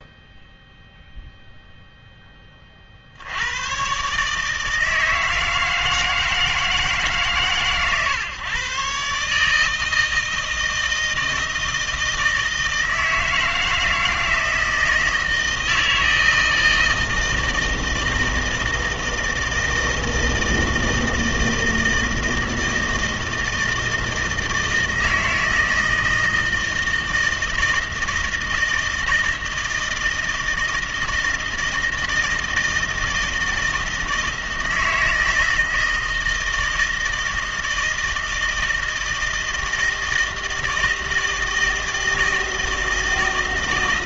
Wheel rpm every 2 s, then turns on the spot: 0, 40, 160, 160, 130, 160, 160, 160, 160, 160, 160, 160, 160, 160, 160, 160, 160, 160, 160, 160, 160, 160.
none